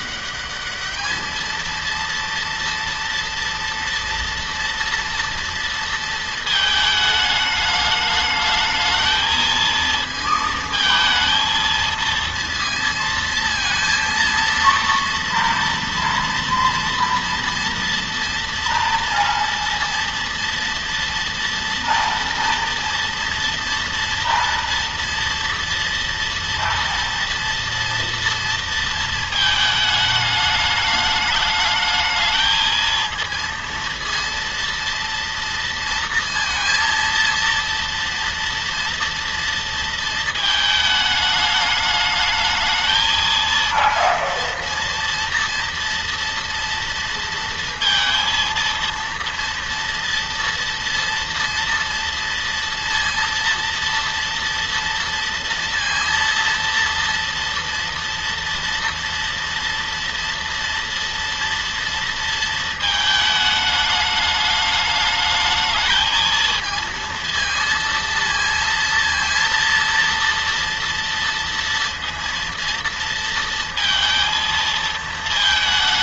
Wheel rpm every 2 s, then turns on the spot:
210, 230, 230, 220, 220, 230, 230, 230, 230, 230, 230, 230, 230, 230, 230, 210, 220, 230, 230, 230, 220, 220, 230, 230, 230, 230, 230, 230, 230, 230, 230, 230, 210, 220, 230, 230, 230, 230.
none